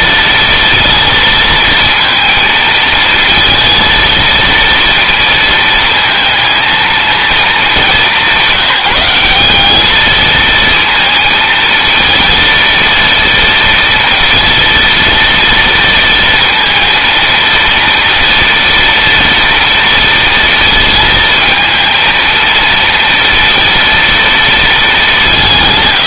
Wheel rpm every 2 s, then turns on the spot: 230, 220, 230, 230, 180, 230, 230, 230, 230, 230, 230, 230, 210.
none